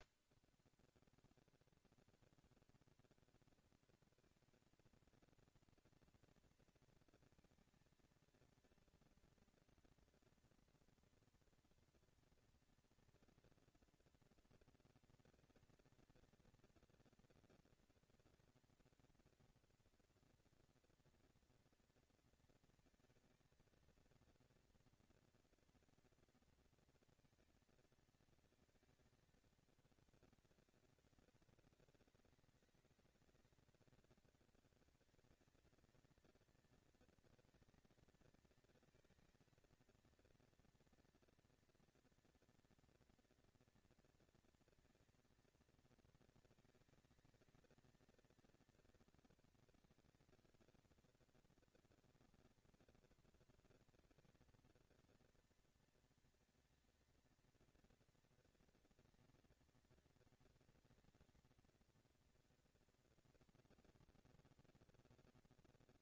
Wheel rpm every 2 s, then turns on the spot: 150, 200, 230, 230, 230, 240, 230, 230, 230, 230, 230, 230, 230, 230, 220, 200, 190, 210, 230, 220, 230, 240, 230, 220, 230, 220, 230, 230, 230, 230, 220, 230, 230.
none